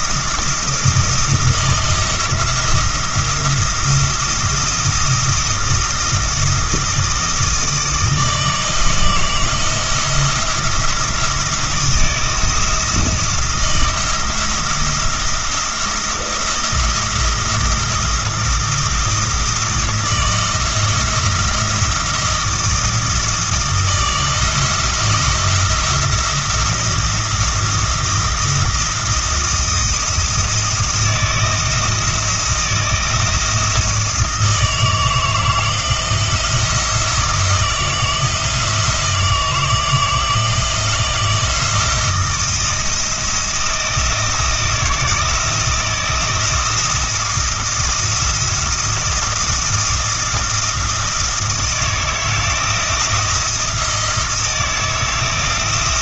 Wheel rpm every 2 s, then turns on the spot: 170, 170, 170, 160, 160, 170, 170, 170, 170, 170, 170, 170, 170, 170, 170, 170, 170, 160, 170, 160, 170, 160, 170, 170, 170, 170, 160, 170.
none